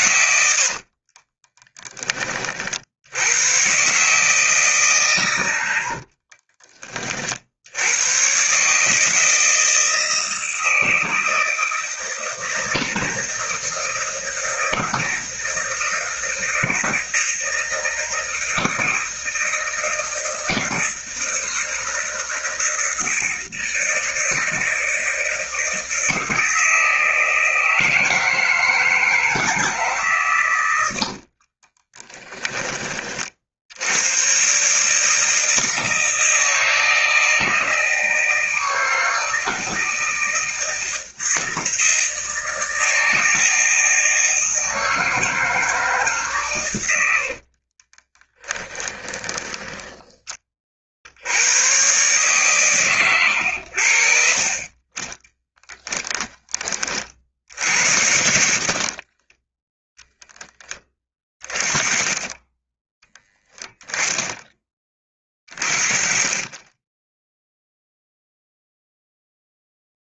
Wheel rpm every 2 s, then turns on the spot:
60, 70, 150, 40, 150, 160, 160, 160, 160, 160, 160, 160, 160, 160, 160, 80, 20, 150, 160, 160, 160, 160, 160, 90, 20, 50, 130, 30, 40, 50, 20, 10, 20, 10, 0.
0-2 30-32 46-50 58-60